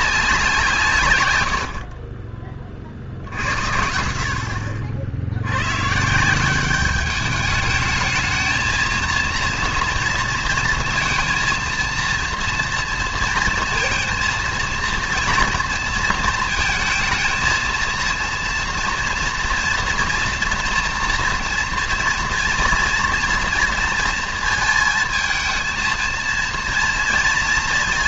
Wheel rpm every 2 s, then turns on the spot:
140, 40, 60, 190, 220, 230, 230, 230, 230, 230, 230, 230, 230, 230.
none